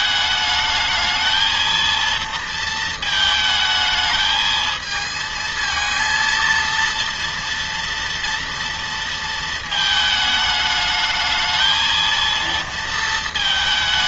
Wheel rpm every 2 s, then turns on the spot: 220, 220, 220, 230, 230, 210, 230.
none